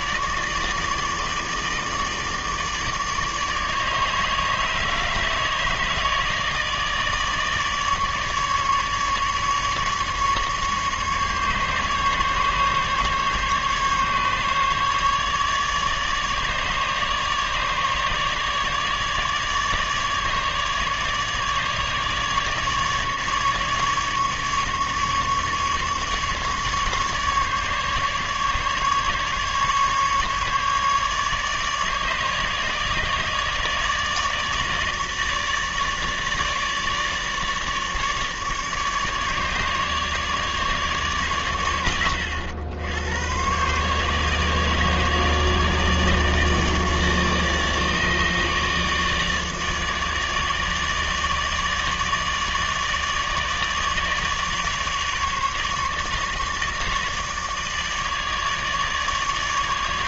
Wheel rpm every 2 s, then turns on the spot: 150, 150, 150, 150, 150, 150, 140, 150, 150, 150, 150, 150, 150, 150, 150, 150, 150, 150, 150, 150, 150, 100, 150, 150, 150, 150, 150, 150, 150, 150.
none